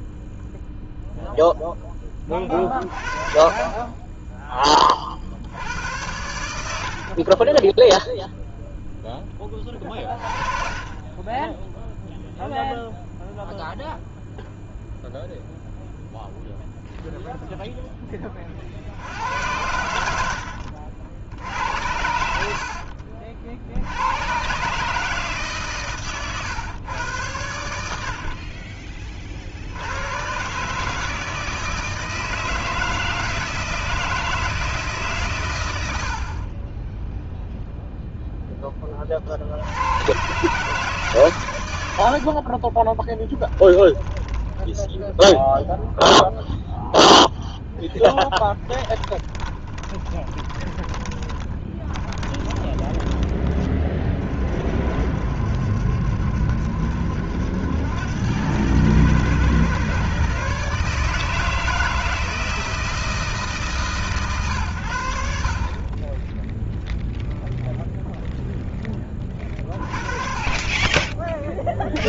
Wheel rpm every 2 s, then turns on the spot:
0, 30, 30, 70, 0, 30, 0, 0, 0, 70, 70, 60, 150, 110, 30, 150, 160, 150, 10, 20, 150, 30, 10, 0, 10, 10, 20, 60, 70, 110, 150, 160, 100, 0, 10, 20.
22-24 42-44 48-54